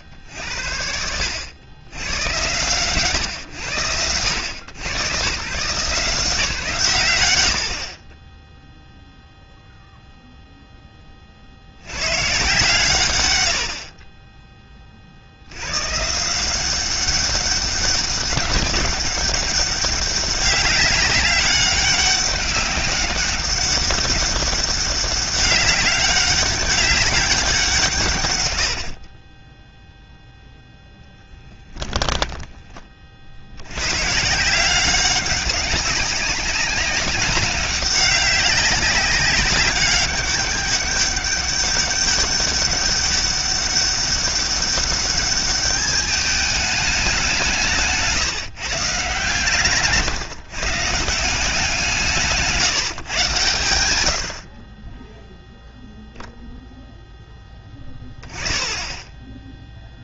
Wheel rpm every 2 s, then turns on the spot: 110, 70, 160, 30, 0, 60, 80, 60, 200, 200, 200, 200, 200, 190, 20, 0, 30, 180, 190, 190, 200, 200, 200, 200, 140, 150, 150, 30, 0, 10.
28-30